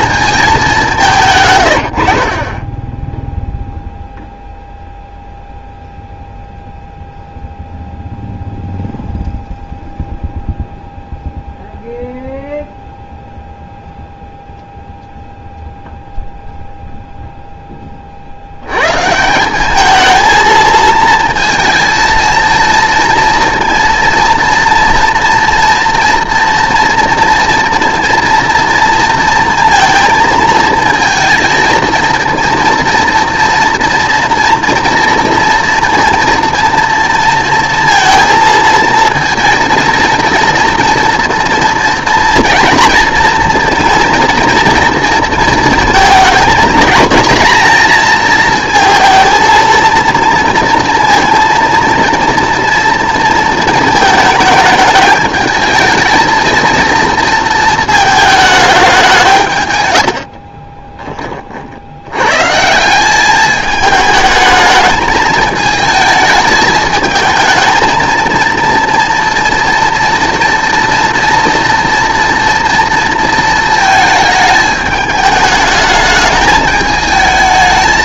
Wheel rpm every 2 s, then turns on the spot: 190, 10, 0, 0, 0, 0, 0, 0, 0, 100, 230, 230, 230, 230, 230, 230, 230, 230, 230, 230, 240, 230, 230, 230, 230, 230, 230, 220, 230, 200, 30, 160, 220, 220, 230, 230, 230, 220, 210.
2-4 60-62